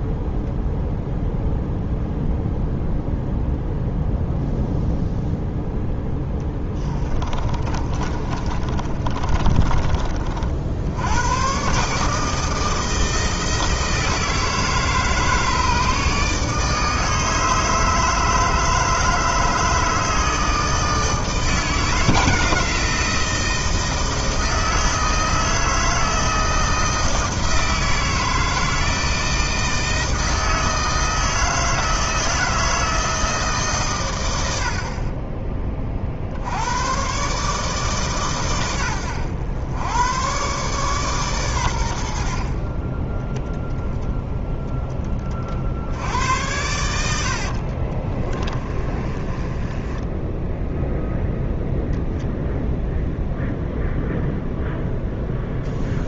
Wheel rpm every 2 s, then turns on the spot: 0, 0, 0, 10, 30, 70, 160, 160, 160, 160, 160, 160, 160, 160, 160, 160, 160, 60, 100, 110, 130, 40, 20, 90, 30, 0, 0, 0.
6-10 48-50